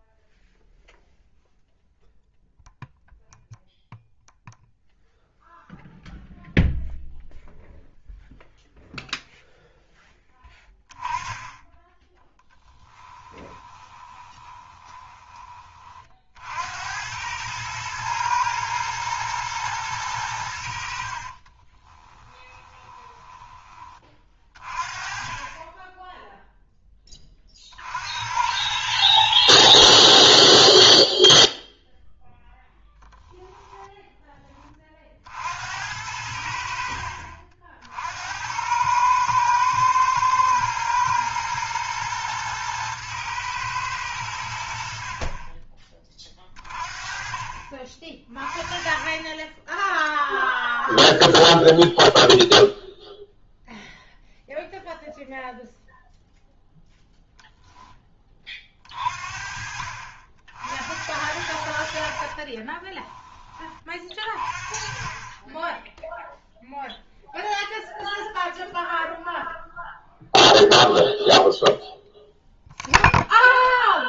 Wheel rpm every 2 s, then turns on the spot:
0, 0, 0, 0, 0, 10, 10, 20, 70, 110, 80, 10, 40, 10, 90, 10, 0, 20, 70, 100, 110, 110, 80, 30, 30, 0, 0, 0, 0, 40, 70, 30, 30, 0, 0, 0, 0.
12-16 22-24 30-32 62-64